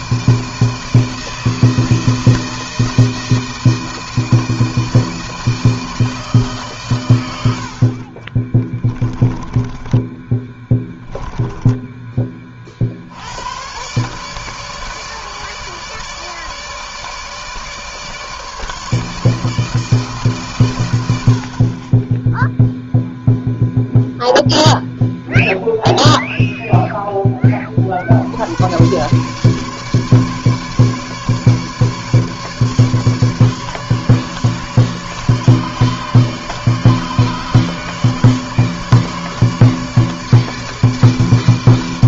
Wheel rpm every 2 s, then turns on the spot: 160, 160, 160, 130, 20, 20, 70, 150, 150, 160, 90, 0, 0, 10, 120, 150, 150, 150, 150, 150, 150.
8-12